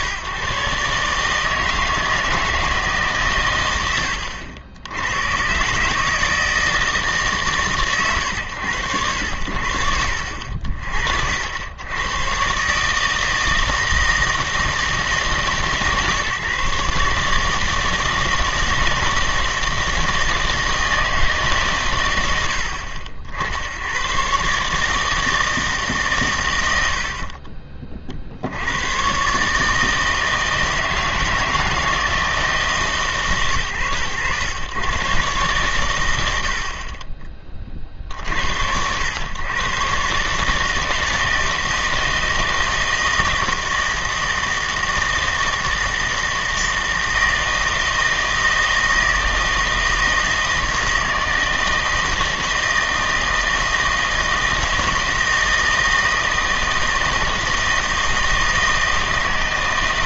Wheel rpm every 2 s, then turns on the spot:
140, 160, 80, 160, 100, 60, 150, 160, 150, 160, 160, 60, 150, 80, 110, 160, 140, 110, 40, 90, 160, 160, 160, 160, 160, 160, 160, 160, 160, 160.
none